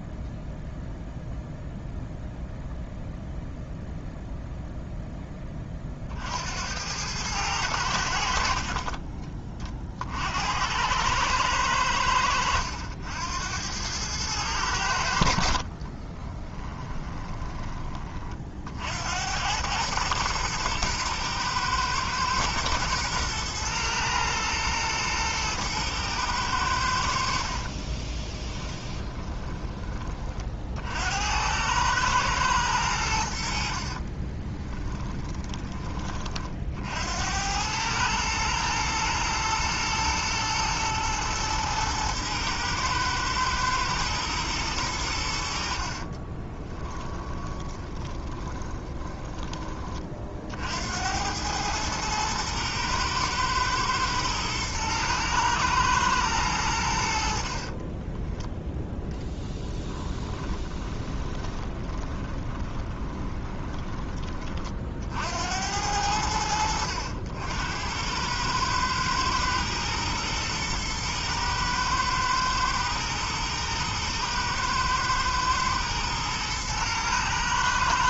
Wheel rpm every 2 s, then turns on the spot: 0, 0, 0, 90, 30, 100, 90, 80, 20, 70, 110, 120, 110, 80, 20, 60, 90, 20, 70, 110, 110, 110, 100, 20, 10, 80, 110, 110, 80, 10, 20, 20, 40, 70, 110, 110, 110, 120, 110.
8-10 16-18 28-30 34-36 46-48 60-64